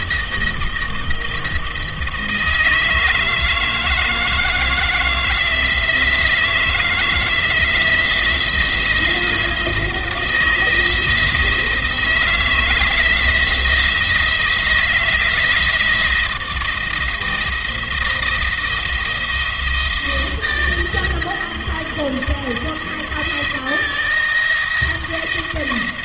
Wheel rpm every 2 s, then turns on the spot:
160, 160, 160, 160, 170, 160, 160, 170, 170, 170, 170, 170, 170.
none